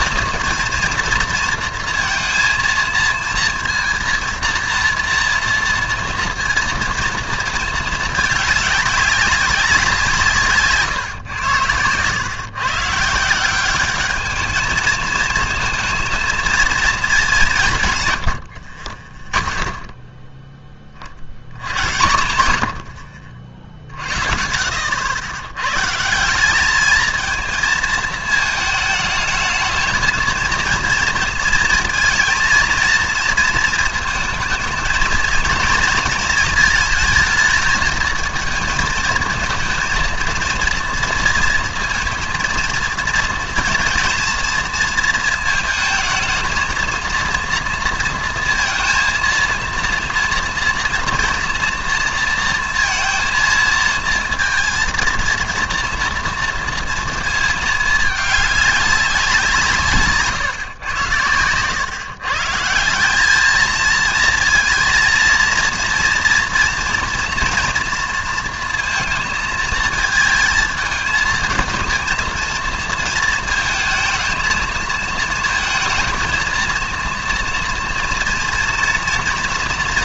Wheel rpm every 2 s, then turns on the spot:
240, 230, 230, 230, 200, 150, 140, 220, 230, 60, 10, 100, 60, 190, 220, 230, 230, 220, 220, 220, 230, 230, 230, 220, 230, 230, 230, 230, 230, 200, 130, 160, 230, 230, 230, 230, 230, 220, 230, 230.
none